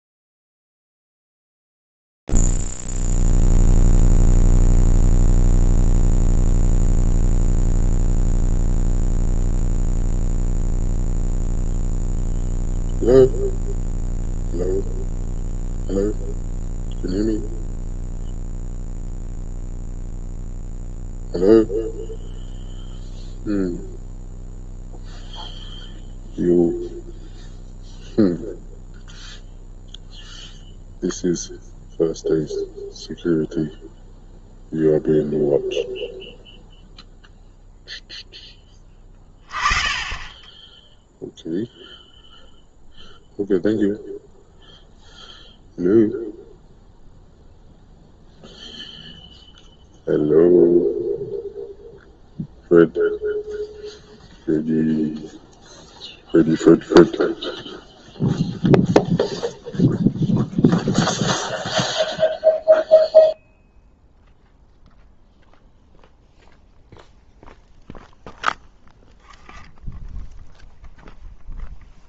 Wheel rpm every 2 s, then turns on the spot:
0, 0, 0, 0, 0, 0, 0, 0, 0, 0, 0, 0, 0, 0, 0, 0, 0, 0, 0, 10, 10, 0, 0, 0, 0, 0, 0, 0, 0, 0, 0, 0, 0, 0, 0, 0.
none